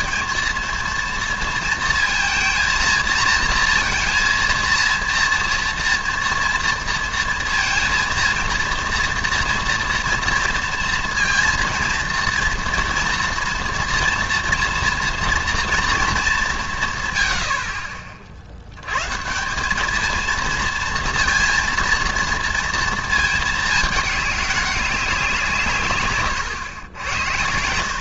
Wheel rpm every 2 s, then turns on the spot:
230, 230, 230, 230, 230, 230, 230, 230, 170, 80, 230, 230, 200, 110.
26-28